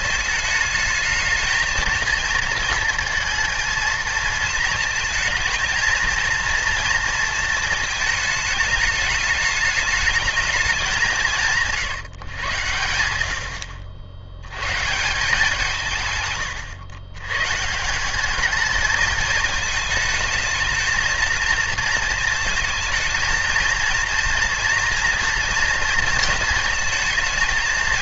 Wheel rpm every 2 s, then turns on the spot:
220, 230, 220, 230, 220, 200, 100, 130, 110, 210, 220, 220, 230, 230.
none